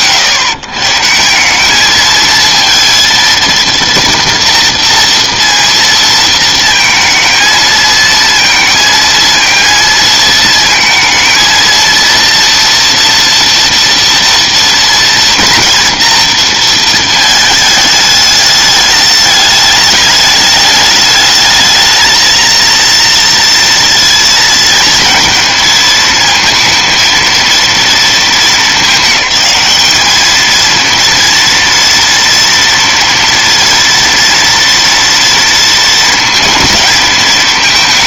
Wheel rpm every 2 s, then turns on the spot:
130, 230, 230, 230, 230, 230, 230, 230, 230, 210, 210, 230, 230, 230, 210, 230, 240, 230, 230.
none